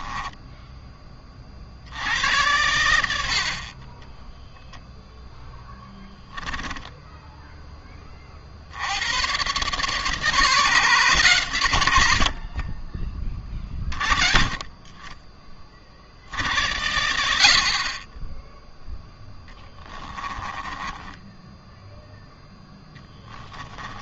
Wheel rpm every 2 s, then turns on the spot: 20, 90, 10, 10, 70, 150, 40, 20, 90, 10, 20, 10.
0-2 6-8 20-22